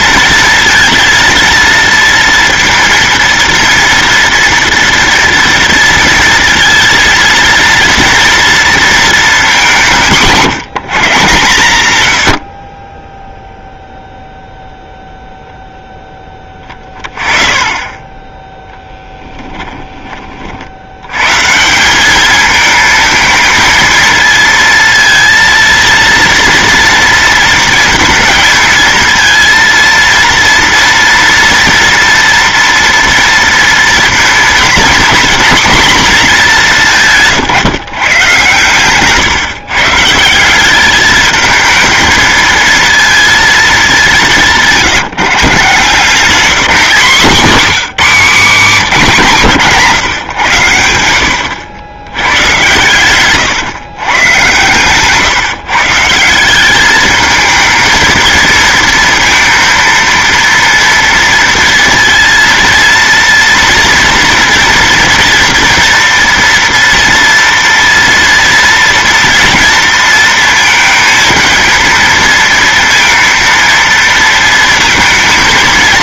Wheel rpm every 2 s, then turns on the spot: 230, 230, 230, 230, 230, 160, 20, 0, 20, 10, 100, 220, 230, 230, 230, 230, 230, 240, 180, 130, 210, 230, 160, 190, 190, 90, 120, 130, 210, 230, 230, 230, 230, 230, 230, 230, 230, 210.
18-20 52-54